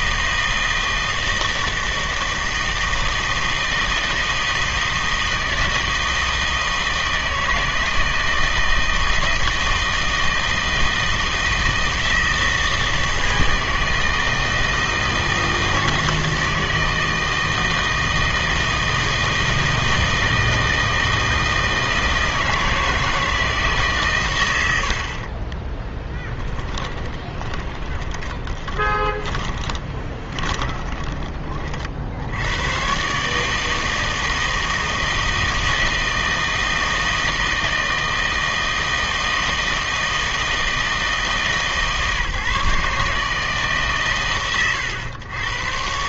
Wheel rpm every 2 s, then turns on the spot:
160, 160, 160, 160, 160, 160, 160, 160, 160, 160, 160, 160, 90, 10, 20, 20, 110, 160, 160, 160, 160, 150, 110.
26-32